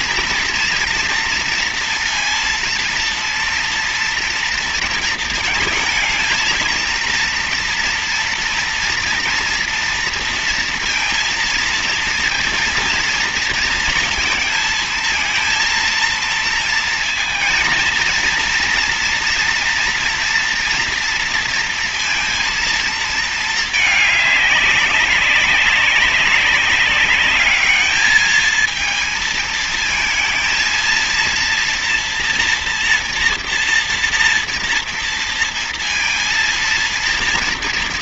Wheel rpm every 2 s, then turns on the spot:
230, 230, 230, 230, 230, 230, 230, 220, 230, 230, 230, 230, 200, 190, 220, 230, 230, 230, 230.
none